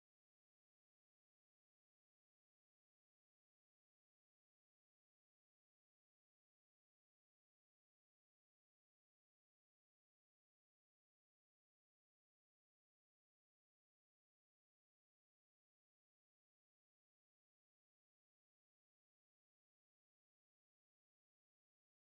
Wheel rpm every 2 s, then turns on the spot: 0, 0, 0, 0, 0, 0, 0, 0, 0, 0, 0.
none